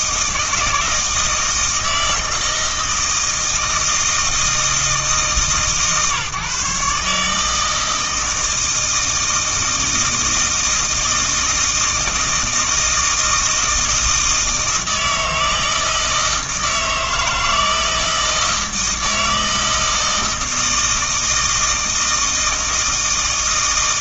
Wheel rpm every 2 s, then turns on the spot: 160, 160, 160, 140, 160, 160, 160, 160, 160, 160, 160, 160.
none